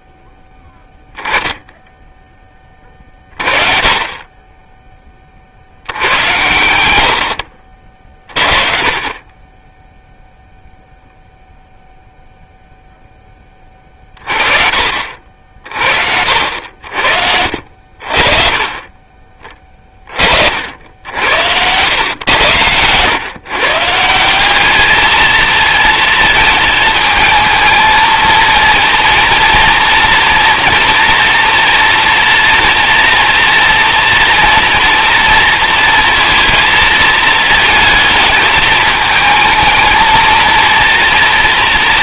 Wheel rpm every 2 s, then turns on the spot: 10, 30, 20, 80, 30, 0, 0, 50, 70, 30, 80, 110, 210, 220, 230, 230, 240, 230, 220, 220, 230.
none